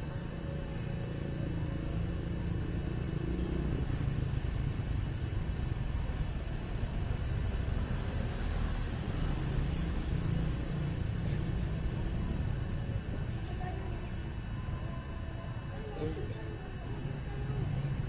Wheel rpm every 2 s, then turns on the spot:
0, 0, 0, 0, 0, 0, 0, 0, 0.
none